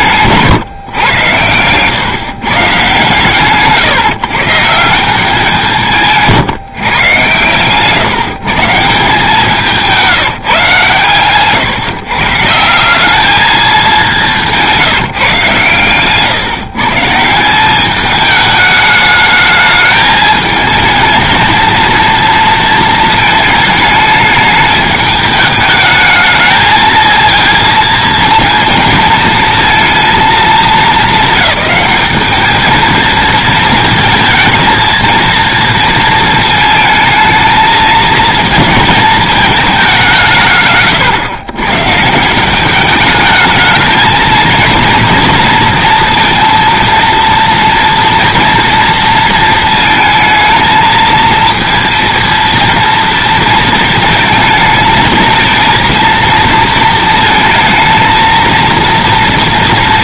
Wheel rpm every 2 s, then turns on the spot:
140, 150, 160, 160, 160, 150, 160, 180, 140, 210, 220, 230, 210, 220, 230, 220, 220, 230, 220, 220, 150, 180, 230, 230, 230, 220, 230, 220, 230, 230.
none